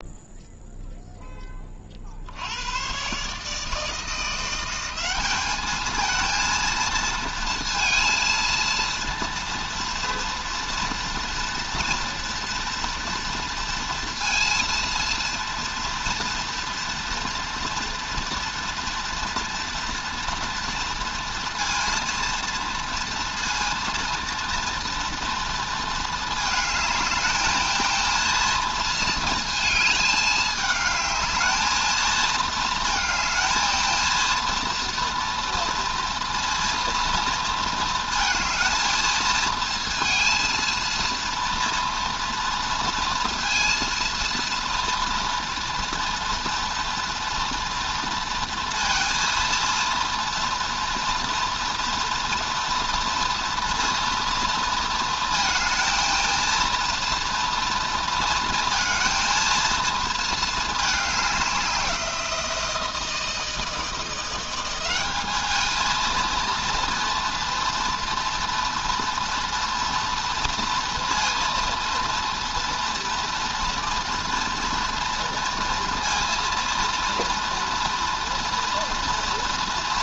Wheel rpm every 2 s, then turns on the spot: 0, 90, 180, 230, 230, 230, 230, 230, 230, 230, 240, 230, 230, 220, 230, 210, 230, 230, 230, 220, 230, 230, 230, 230, 230, 230, 230, 230, 230, 230, 220, 170, 180, 230, 230, 230, 230, 230, 230, 230.
none